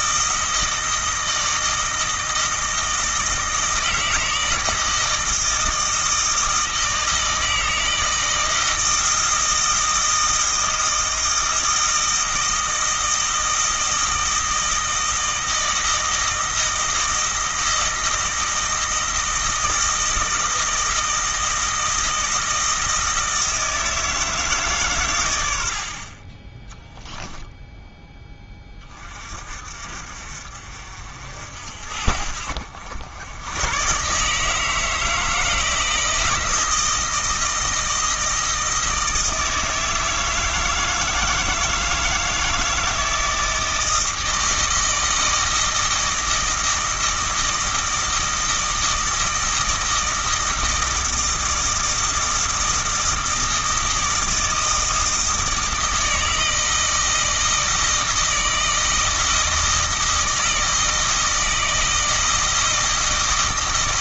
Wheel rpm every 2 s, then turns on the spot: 160, 160, 160, 160, 160, 160, 160, 160, 160, 160, 160, 160, 140, 10, 20, 50, 70, 160, 160, 160, 160, 160, 160, 160, 160, 160, 160, 160, 160, 160, 160, 160.
none